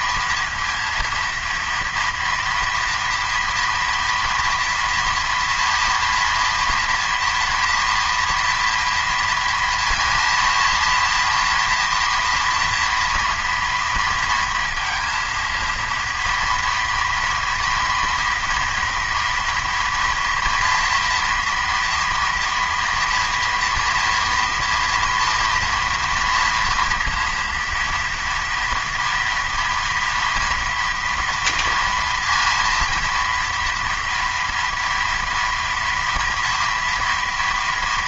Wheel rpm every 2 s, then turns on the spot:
230, 230, 230, 240, 230, 230, 230, 230, 230, 230, 230, 230, 230, 230, 230, 230, 230, 230, 230.
none